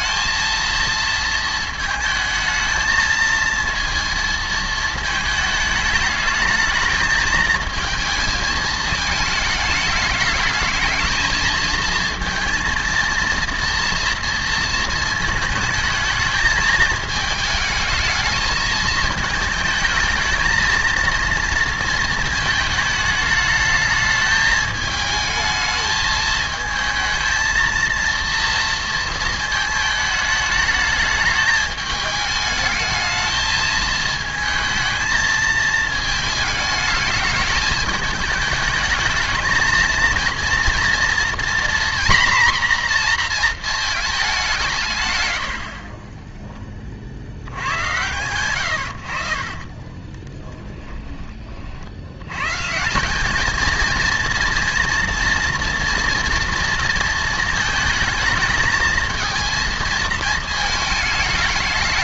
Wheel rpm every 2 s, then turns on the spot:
230, 220, 230, 220, 220, 220, 230, 230, 220, 220, 220, 210, 210, 220, 230, 220, 220, 220, 210, 220, 230, 240, 180, 20, 90, 10, 150, 230, 230, 220, 220.
50-52